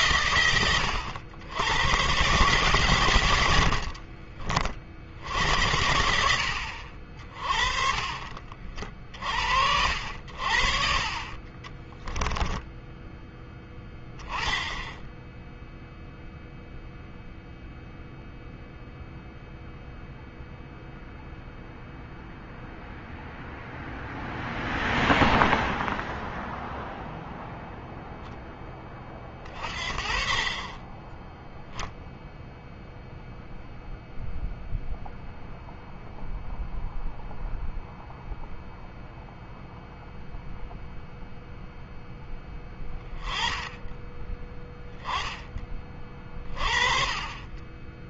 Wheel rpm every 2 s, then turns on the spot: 90, 110, 60, 60, 50, 50, 10, 10, 0, 0, 0, 0, 0, 0, 30, 20, 0, 0, 0, 0, 0, 10, 0, 30.
2-4 10-12